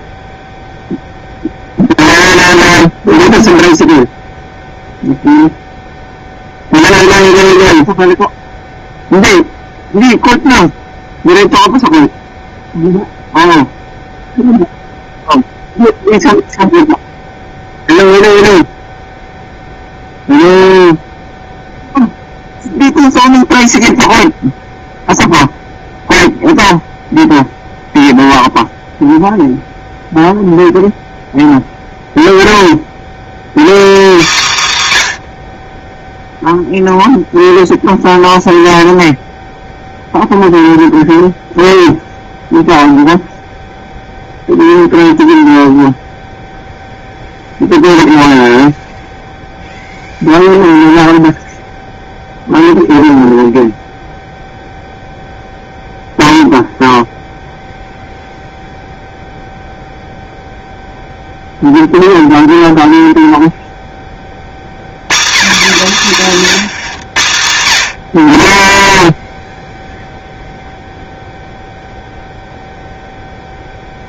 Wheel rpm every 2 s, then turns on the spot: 0, 0, 0, 0, 0, 0, 0, 0, 0, 0, 0, 0, 0, 0, 0, 0, 0, 120, 0, 0, 0, 0, 0, 0, 0, 0, 0, 0, 0, 0, 0, 0, 60, 160, 20, 0, 0.
none